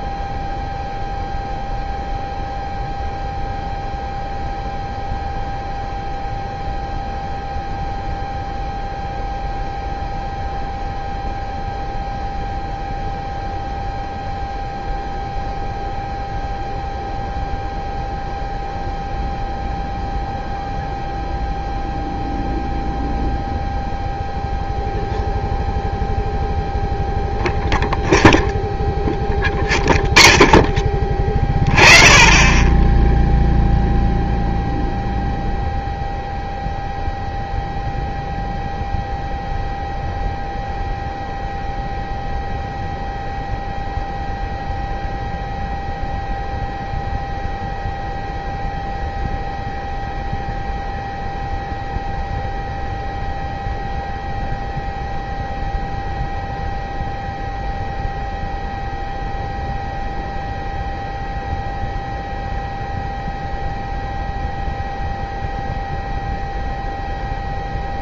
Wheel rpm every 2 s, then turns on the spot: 0, 0, 0, 0, 0, 0, 0, 0, 0, 0, 0, 0, 0, 0, 0, 20, 20, 0, 0, 0, 0, 0, 0, 0, 0, 0, 0, 0, 0, 0, 0, 0, 0, 0.
none